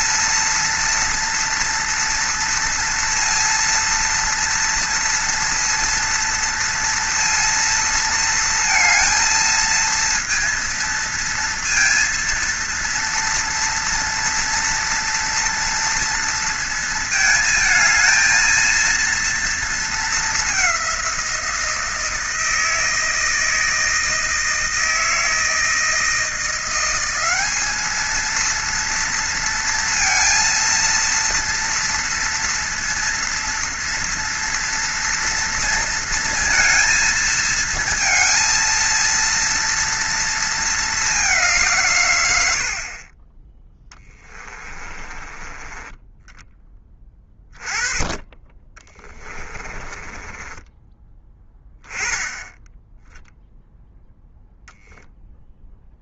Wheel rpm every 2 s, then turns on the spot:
230, 230, 230, 230, 230, 230, 230, 240, 230, 230, 200, 160, 160, 170, 230, 230, 230, 230, 230, 230, 230, 90, 20, 10, 20, 20, 10, 0.
44-46 50-52